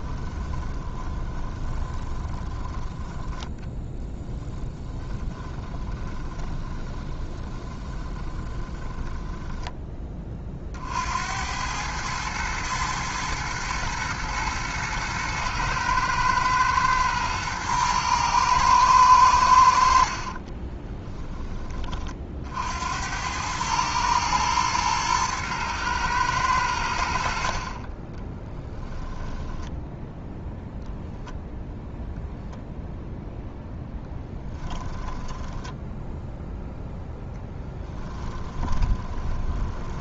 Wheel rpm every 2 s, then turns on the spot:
20, 20, 20, 20, 20, 60, 110, 110, 110, 110, 20, 80, 110, 90, 10, 0, 0, 10, 0, 20.
0-2 4-10 20-22 28-30 34-36 38-40